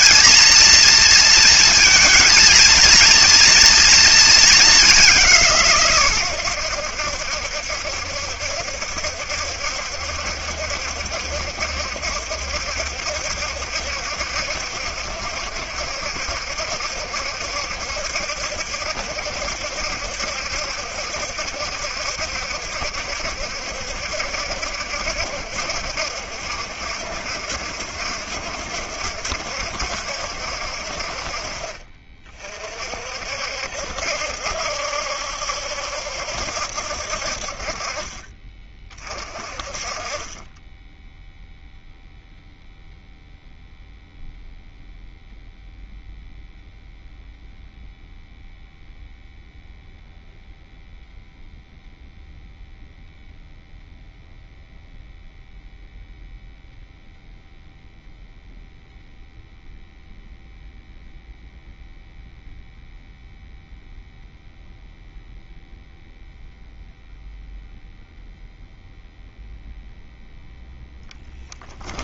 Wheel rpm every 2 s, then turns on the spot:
240, 230, 200, 90, 70, 70, 70, 70, 70, 70, 70, 70, 70, 70, 70, 60, 40, 70, 70, 40, 10, 0, 0, 0, 0, 0, 0, 0, 0, 0, 0, 0, 0, 0, 0, 0.
none